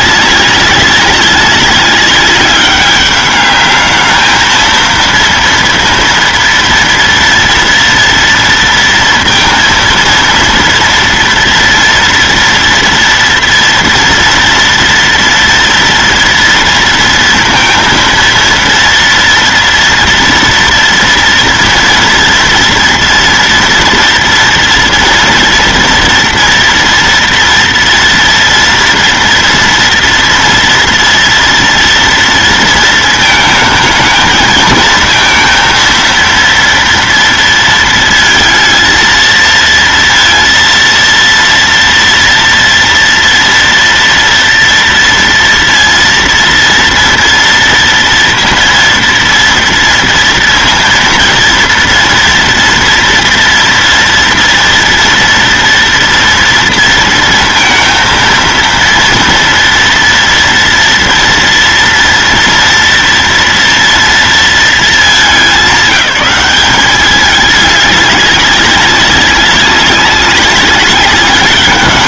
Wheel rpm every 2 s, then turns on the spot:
190, 200, 230, 230, 230, 230, 230, 230, 230, 230, 230, 240, 230, 230, 240, 230, 220, 220, 230, 230, 230, 230, 230, 230, 230, 230, 230, 230, 230, 230, 230, 230, 220, 200, 200, 200.
none